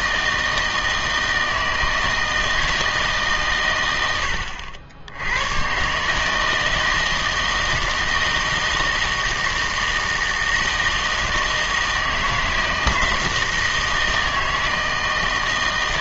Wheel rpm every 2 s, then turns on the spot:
160, 160, 70, 160, 160, 160, 160, 160.
none